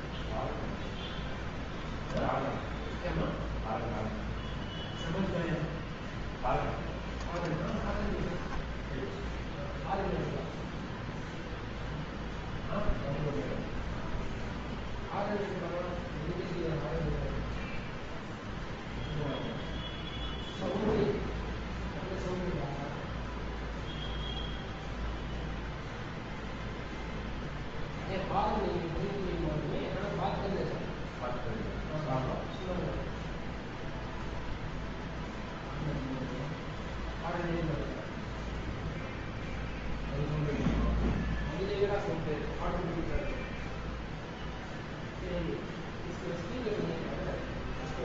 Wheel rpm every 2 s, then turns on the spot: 0, 0, 0, 0, 0, 0, 0, 0, 0, 0, 0, 0, 0, 0, 0, 0, 0, 0, 0, 0, 0, 0, 0, 0.
none